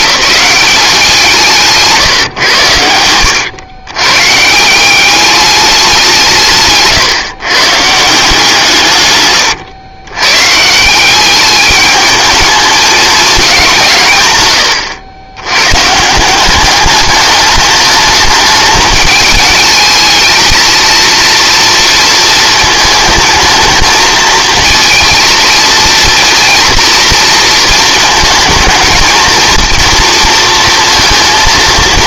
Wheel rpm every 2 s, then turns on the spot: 190, 110, 180, 140, 150, 180, 210, 110, 210, 210, 220, 220, 230, 230, 230, 230.
none